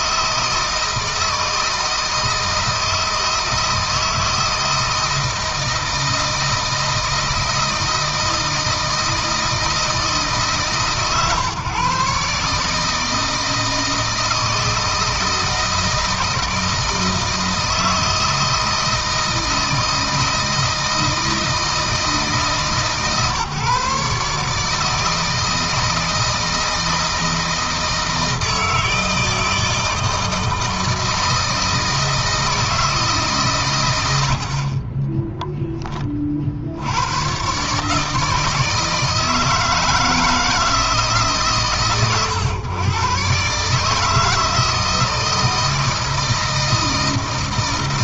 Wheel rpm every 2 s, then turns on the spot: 160, 160, 160, 160, 160, 150, 150, 160, 160, 160, 160, 150, 160, 160, 160, 160, 160, 30, 80, 160, 160, 120, 160, 160.
34-36